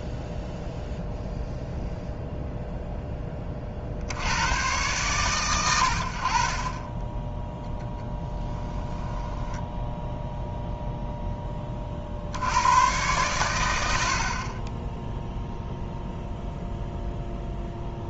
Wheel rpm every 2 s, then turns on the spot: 0, 0, 120, 20, 10, 0, 100, 10, 0.
8-10